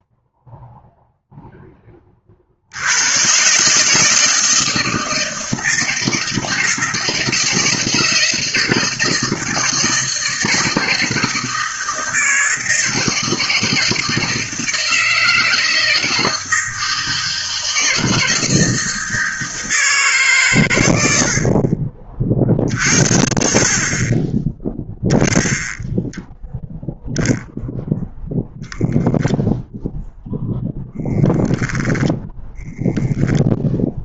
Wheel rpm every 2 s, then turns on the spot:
0, 90, 160, 160, 160, 160, 160, 160, 160, 160, 110, 50, 10, 0, 0, 0, 10.
none